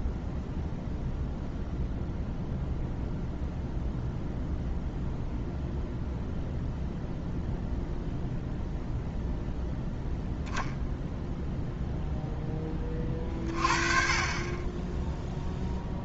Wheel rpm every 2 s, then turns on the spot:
0, 0, 0, 0, 0, 0, 40, 10.
none